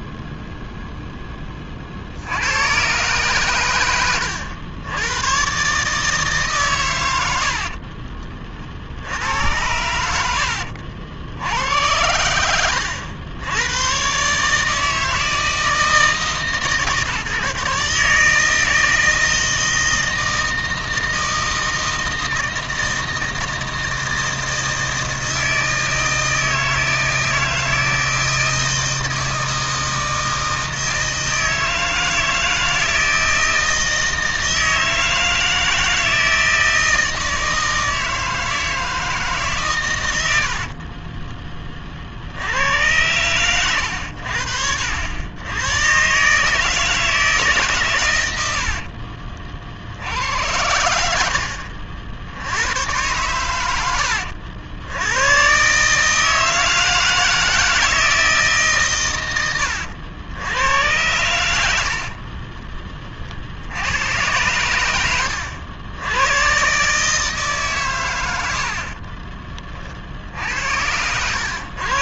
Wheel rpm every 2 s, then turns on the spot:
0, 110, 100, 120, 60, 70, 80, 150, 150, 160, 160, 160, 160, 160, 160, 160, 160, 160, 160, 160, 40, 100, 80, 160, 70, 80, 100, 80, 160, 150, 90, 20, 100, 130, 60, 80.
40-42 48-50